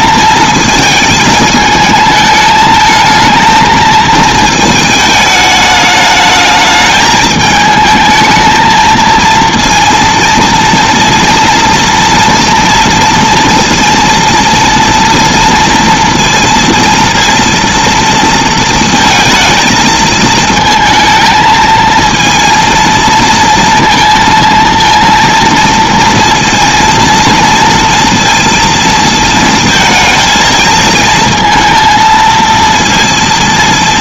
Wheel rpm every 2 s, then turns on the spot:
220, 220, 220, 210, 220, 230, 230, 230, 230, 230, 220, 230, 230, 230, 230, 220, 230.
none